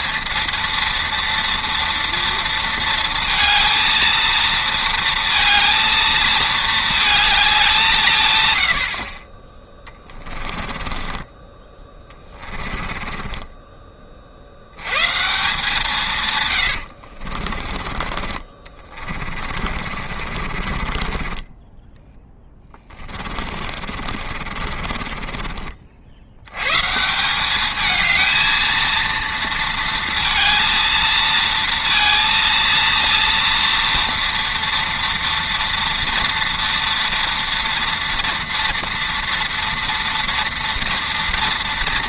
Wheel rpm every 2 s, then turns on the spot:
230, 230, 230, 220, 70, 20, 20, 90, 90, 30, 40, 20, 50, 120, 220, 230, 230, 230, 230, 230, 230.
10-14 16-26